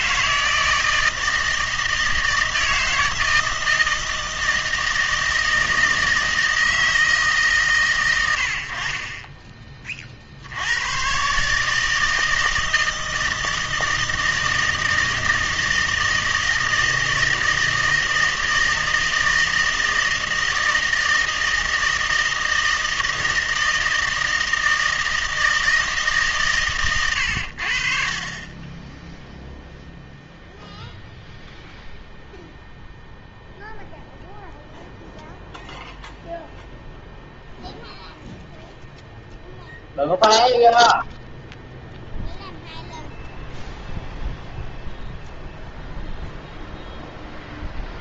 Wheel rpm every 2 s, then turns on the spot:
160, 160, 160, 160, 70, 90, 160, 160, 160, 160, 160, 160, 160, 130, 10, 0, 0, 0, 0, 0, 0, 0, 0, 0.
none